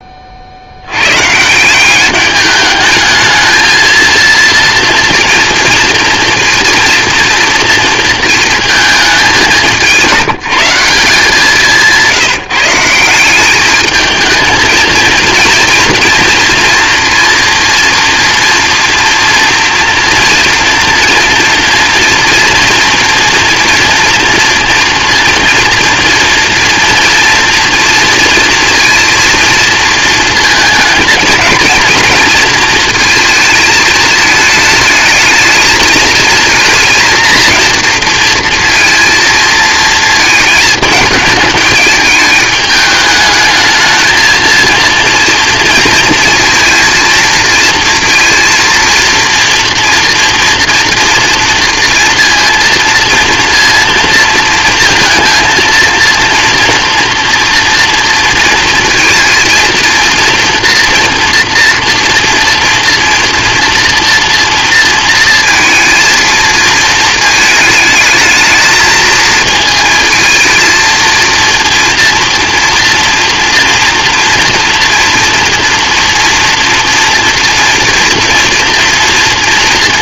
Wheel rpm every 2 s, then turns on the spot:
110, 210, 230, 230, 210, 170, 180, 220, 230, 230, 240, 230, 230, 230, 230, 220, 230, 220, 230, 230, 210, 210, 230, 230, 230, 230, 230, 230, 230, 230, 240, 230, 230, 230, 220, 230, 240, 230, 230, 230.
none